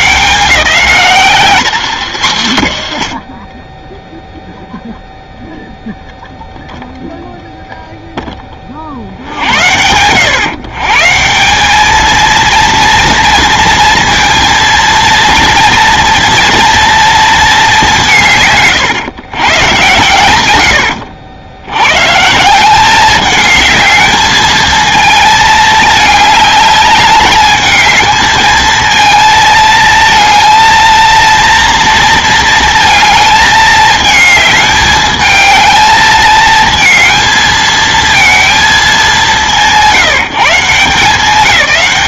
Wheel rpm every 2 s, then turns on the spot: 140, 130, 0, 0, 30, 130, 230, 230, 230, 130, 100, 180, 220, 210, 220, 230, 230, 210, 220, 210, 160.
2-4